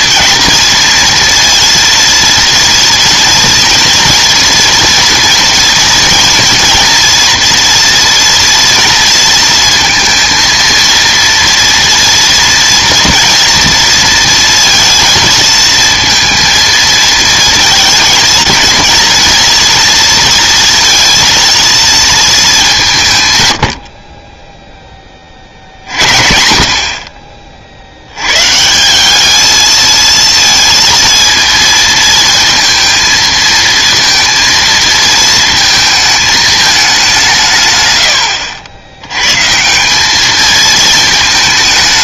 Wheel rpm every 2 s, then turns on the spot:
230, 230, 230, 240, 230, 230, 230, 230, 230, 230, 230, 200, 10, 50, 160, 230, 220, 220, 210, 90, 220.
none